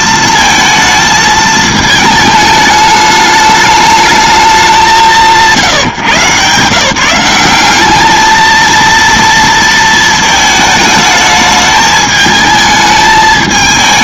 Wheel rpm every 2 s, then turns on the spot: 220, 210, 170, 150, 230, 220, 220.
none